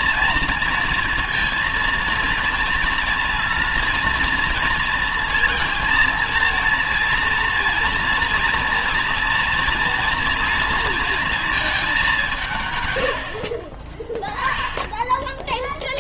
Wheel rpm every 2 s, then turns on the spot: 230, 230, 230, 230, 230, 230, 160, 10.
none